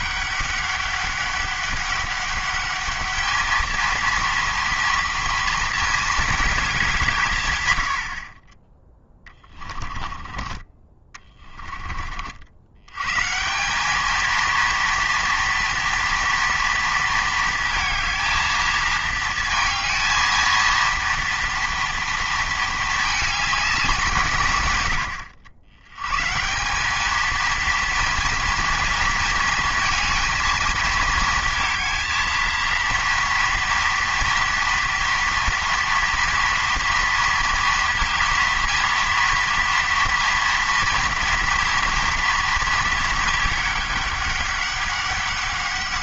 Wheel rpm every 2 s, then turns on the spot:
200, 200, 230, 200, 20, 30, 90, 230, 230, 230, 230, 220, 120, 180, 230, 220, 230, 230, 230, 230, 230, 230, 200.
10-12